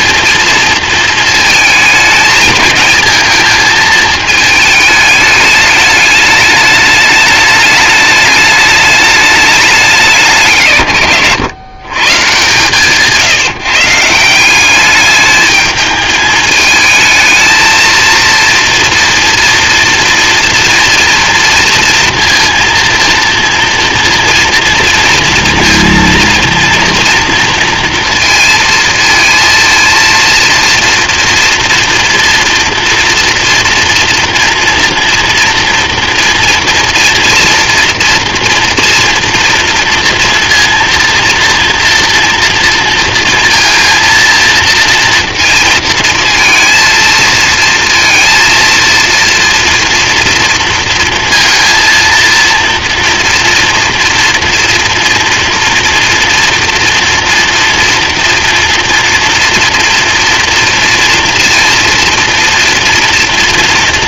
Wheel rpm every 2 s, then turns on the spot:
230, 220, 220, 210, 210, 140, 140, 200, 220, 240, 240, 230, 230, 230, 230, 230, 230, 230, 230, 230, 230, 230, 230, 230, 230, 230, 230, 230, 240, 240, 230, 230.
none